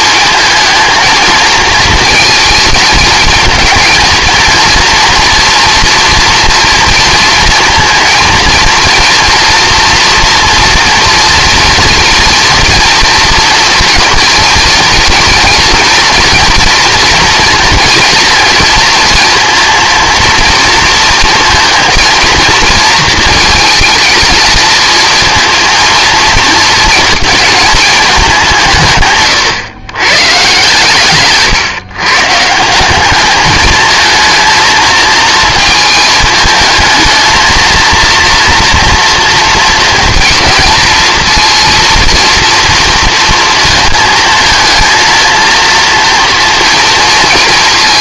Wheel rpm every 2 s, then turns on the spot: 220, 220, 230, 230, 230, 230, 230, 230, 240, 230, 230, 230, 230, 230, 150, 140, 190, 230, 220, 230, 230, 230, 220, 230.
none